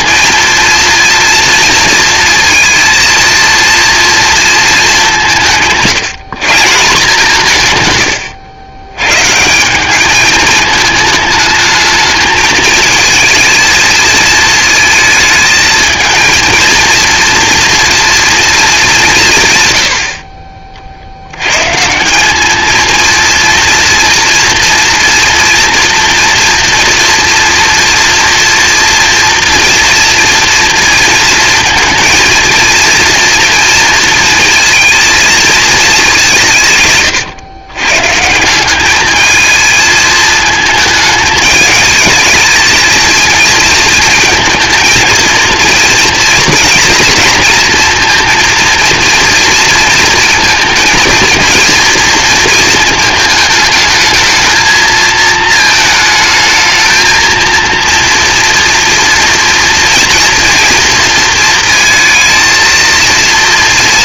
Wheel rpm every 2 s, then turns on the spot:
230, 230, 210, 160, 120, 220, 220, 220, 230, 200, 50, 230, 230, 240, 230, 230, 230, 230, 140, 200, 220, 220, 230, 230, 230, 230, 220, 220, 220, 230, 230, 230.
none